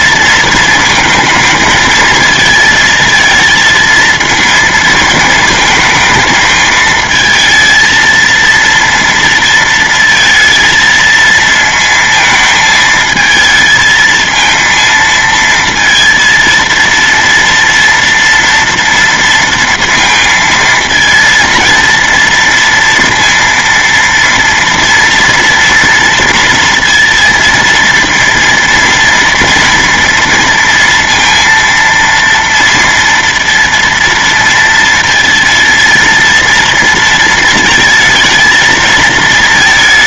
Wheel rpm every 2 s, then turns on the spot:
220, 220, 230, 220, 230, 220, 220, 230, 230, 230, 230, 230, 230, 230, 230, 230, 230, 230, 230, 230.
none